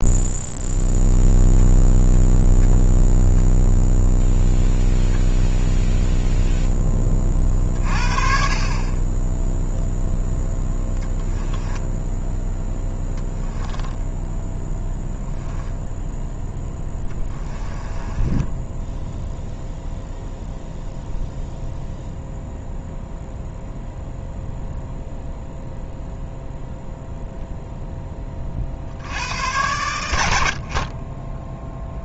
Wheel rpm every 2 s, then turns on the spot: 0, 10, 0, 0, 40, 10, 10, 10, 10, 10, 0, 0, 0, 0, 50, 50.
12-14 16-20